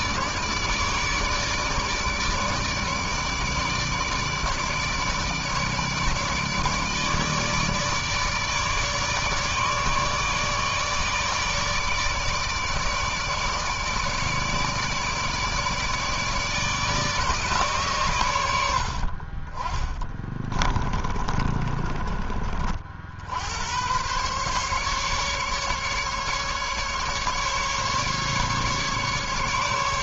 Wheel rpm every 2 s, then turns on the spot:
150, 150, 150, 150, 150, 150, 150, 150, 150, 100, 20, 40, 130, 150, 140.
20-22